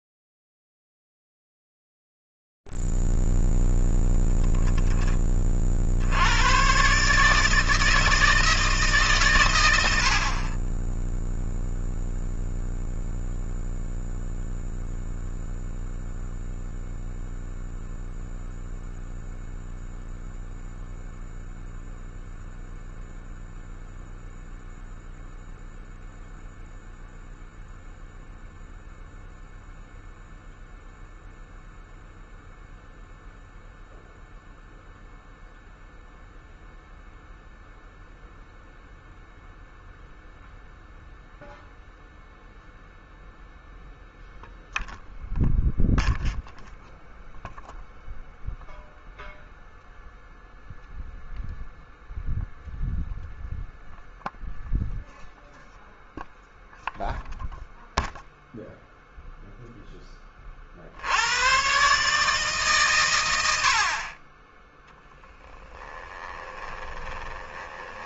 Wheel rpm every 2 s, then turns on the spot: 50, 40, 0, 50, 160, 80, 0, 0, 0, 0, 0, 0, 0, 0, 0, 0, 0, 0, 0, 0, 0, 0, 0, 0, 0, 0, 0, 0, 0, 0, 40, 140, 10, 20.
66-68